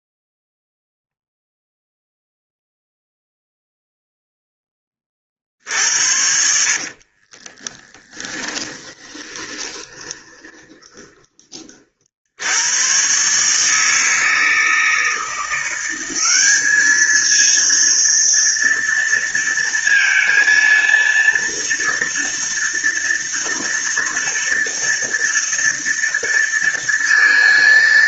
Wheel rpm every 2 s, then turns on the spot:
0, 0, 10, 50, 10, 20, 90, 160, 200, 230, 230, 230, 230, 230.
6-12